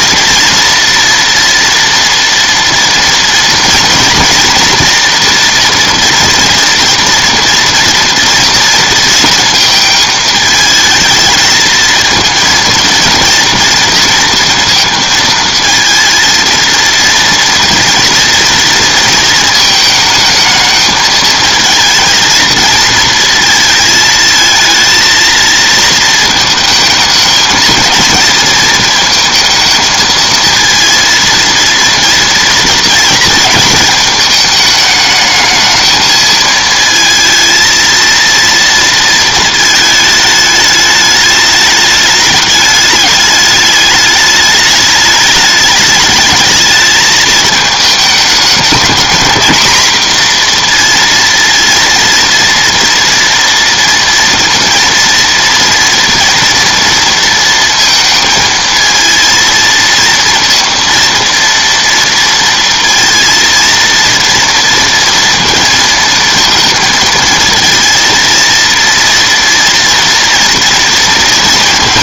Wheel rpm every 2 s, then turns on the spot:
230, 230, 230, 240, 230, 220, 230, 230, 230, 230, 220, 230, 220, 220, 220, 230, 230, 210, 220, 230, 210, 210, 210, 220, 220, 240, 230, 230, 230, 230, 230, 230, 230, 230, 230, 230.
none